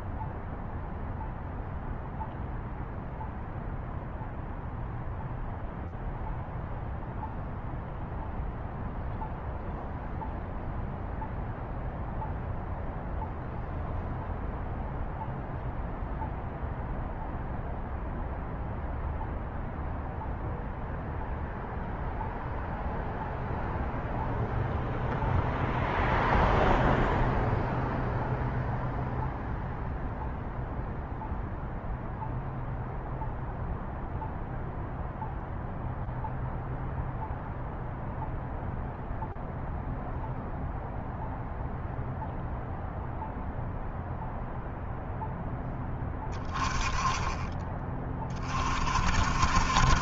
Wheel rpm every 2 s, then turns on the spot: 0, 0, 0, 0, 0, 0, 0, 0, 0, 0, 0, 0, 0, 0, 0, 0, 0, 0, 0, 0, 0, 0, 0, 20, 30.
none